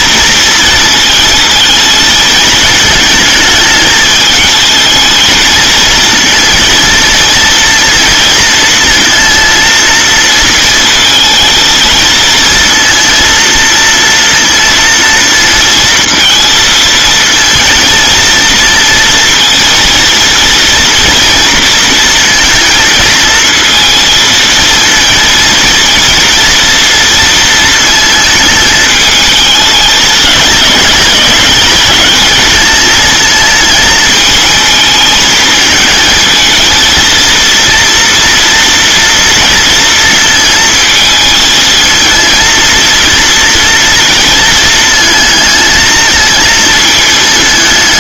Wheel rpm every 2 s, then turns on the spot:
230, 220, 220, 230, 230, 230, 230, 230, 220, 230, 230, 230, 230, 230, 220, 220, 220, 220, 230, 230, 230, 230, 220, 220.
none